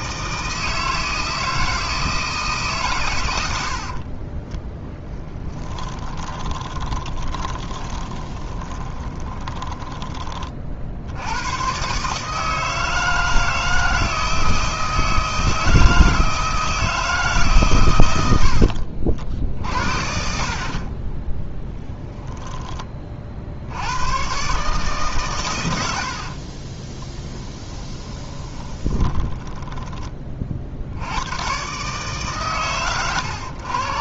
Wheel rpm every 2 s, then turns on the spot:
160, 130, 20, 20, 20, 60, 160, 160, 160, 60, 40, 30, 140, 30, 20, 70, 110.
4-10 18-20 26-30